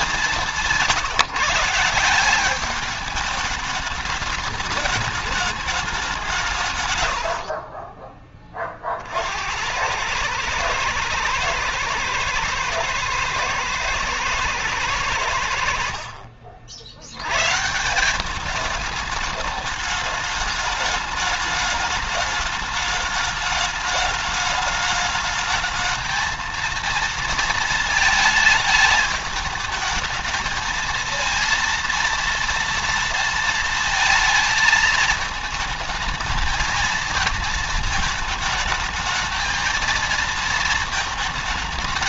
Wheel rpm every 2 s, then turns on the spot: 170, 210, 210, 120, 50, 110, 120, 100, 70, 210, 210, 210, 210, 230, 210, 230, 230, 220, 230, 220, 220.
none